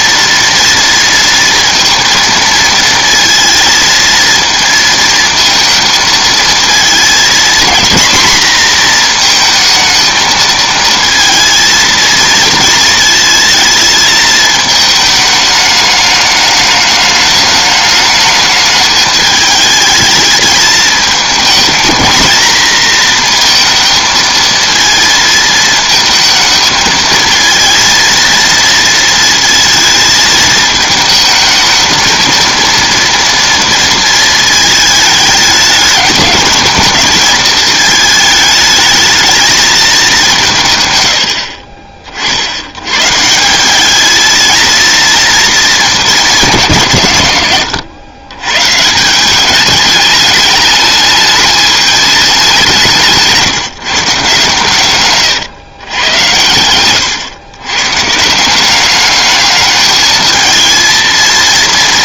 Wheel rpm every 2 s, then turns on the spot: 230, 220, 220, 220, 230, 230, 220, 210, 210, 210, 210, 230, 220, 220, 230, 220, 230, 220, 220, 210, 90, 130, 230, 120, 170, 210, 170, 130, 110, 200, 230.
54-56